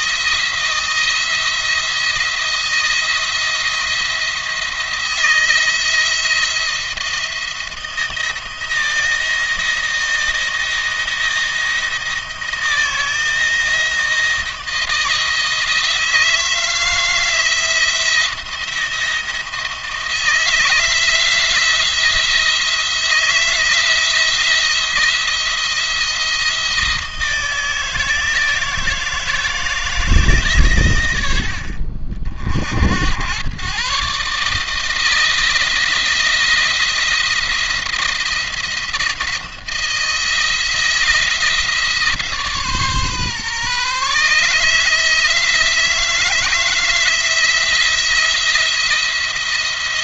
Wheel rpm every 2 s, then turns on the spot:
170, 170, 170, 170, 160, 160, 160, 170, 160, 170, 160, 160, 170, 160, 160, 120, 60, 160, 170, 170, 170, 150, 150, 170, 170.
none